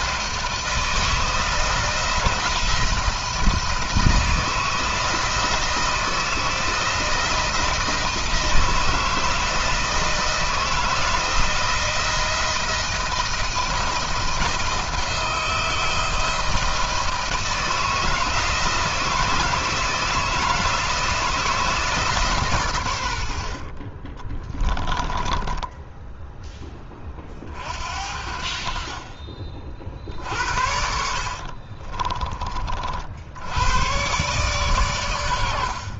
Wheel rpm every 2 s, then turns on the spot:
160, 170, 160, 160, 170, 170, 170, 160, 160, 160, 170, 110, 20, 20, 50, 60, 50, 110.
24-26 30-32